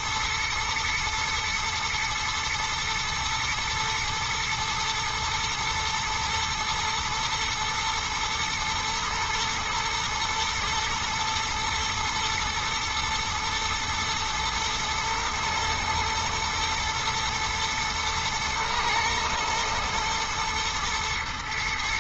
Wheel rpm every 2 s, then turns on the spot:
120, 110, 120, 110, 120, 110, 120, 110, 120, 120, 110.
none